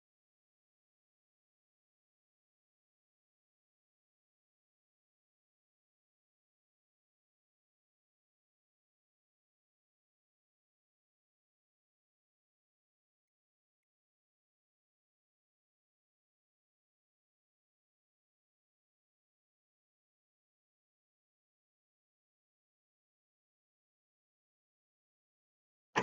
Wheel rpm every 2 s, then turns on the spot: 0, 0, 0, 0, 0, 0, 0, 0, 0, 0, 0, 0, 0.
none